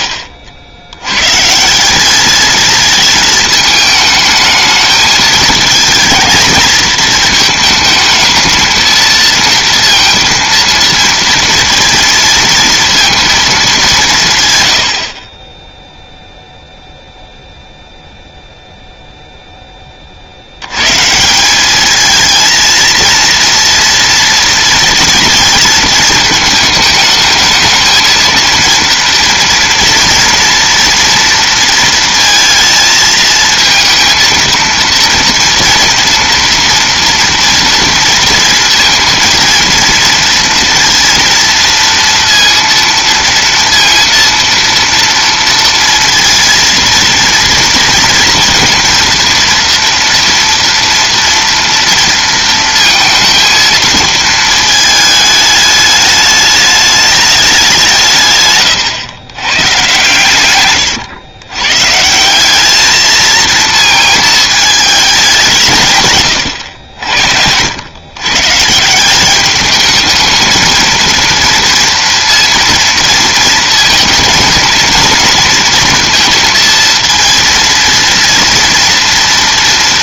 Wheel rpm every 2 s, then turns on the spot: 70, 210, 220, 220, 220, 230, 230, 140, 0, 0, 130, 230, 230, 220, 230, 230, 220, 230, 230, 230, 230, 230, 230, 230, 230, 230, 230, 220, 210, 130, 110, 220, 210, 70, 180, 230, 230, 230, 230, 230.
none